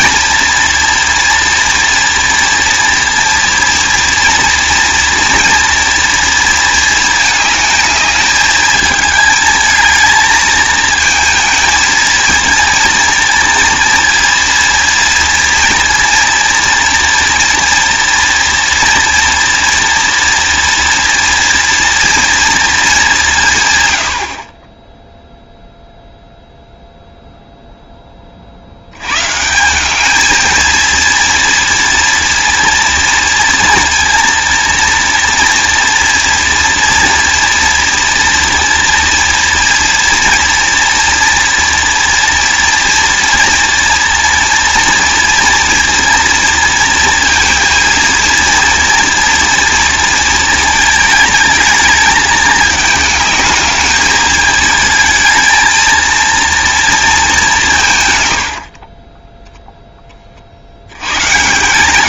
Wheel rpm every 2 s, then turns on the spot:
230, 230, 230, 230, 210, 220, 230, 230, 230, 230, 240, 220, 20, 0, 70, 220, 230, 230, 230, 230, 230, 230, 230, 230, 230, 220, 220, 220, 230, 90, 70.
58-60